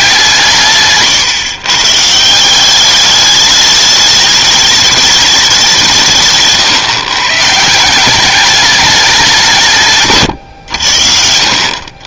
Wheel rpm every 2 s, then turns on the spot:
150, 200, 210, 140, 210, 80.
0-2